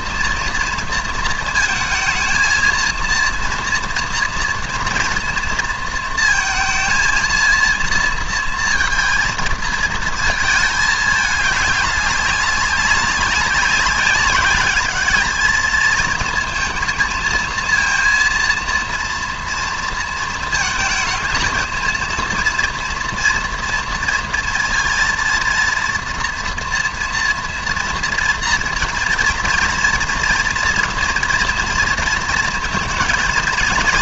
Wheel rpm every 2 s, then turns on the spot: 230, 220, 240, 230, 230, 220, 190, 200, 230, 230, 220, 230, 230, 230, 230, 230, 230.
none